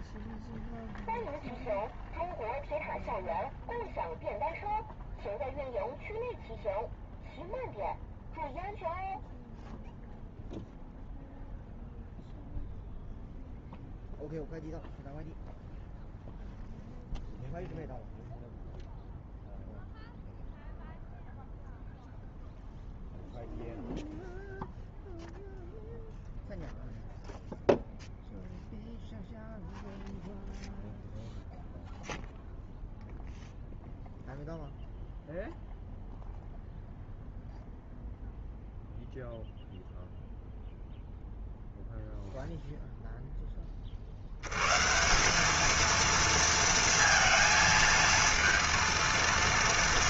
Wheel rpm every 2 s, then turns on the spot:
0, 0, 0, 0, 0, 0, 0, 0, 0, 0, 0, 0, 0, 0, 0, 0, 0, 0, 0, 0, 0, 0, 110, 230, 230.
none